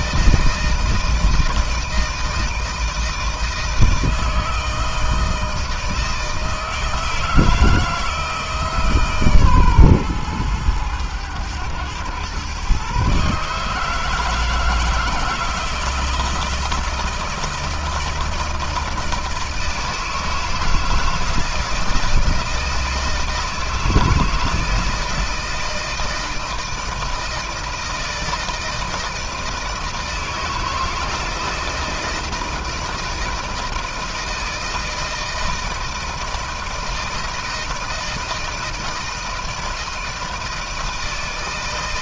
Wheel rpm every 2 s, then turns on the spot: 160, 160, 160, 160, 160, 110, 120, 160, 160, 160, 160, 160, 160, 160, 160, 160, 160, 160, 160, 160, 160.
none